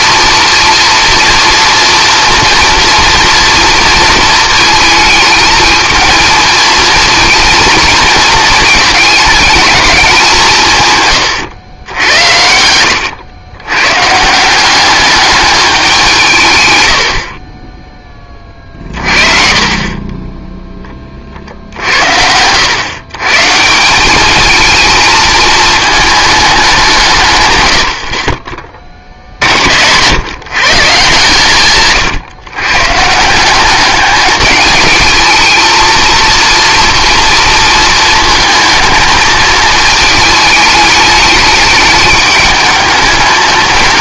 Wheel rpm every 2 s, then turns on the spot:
230, 230, 220, 230, 220, 150, 90, 190, 110, 40, 10, 110, 210, 190, 30, 150, 140, 210, 230, 220, 210, 210.
12-14